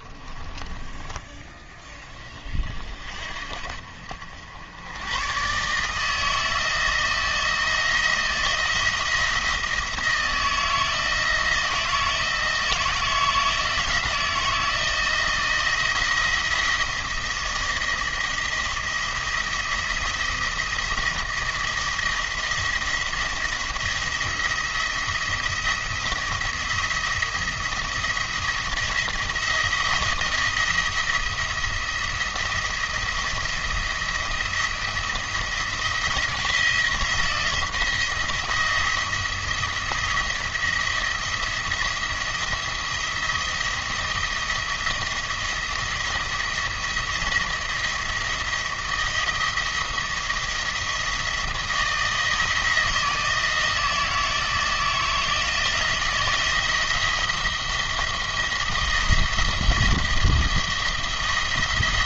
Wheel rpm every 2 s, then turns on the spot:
20, 50, 80, 160, 170, 160, 160, 170, 170, 170, 170, 170, 170, 170, 170, 160, 170, 170, 170, 170, 170, 170, 160, 170, 170, 160, 160, 160, 160, 170, 160.
0-2